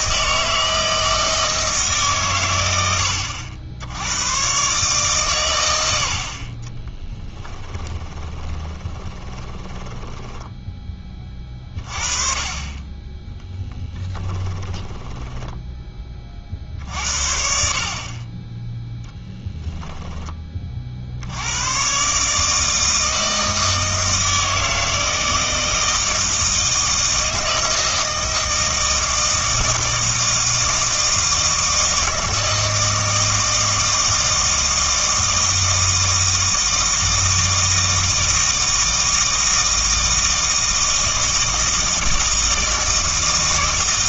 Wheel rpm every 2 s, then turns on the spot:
160, 90, 130, 20, 20, 20, 20, 20, 50, 10, 40, 160, 160, 160, 160, 160, 160, 160, 160, 160, 160, 160.
6-10 14-16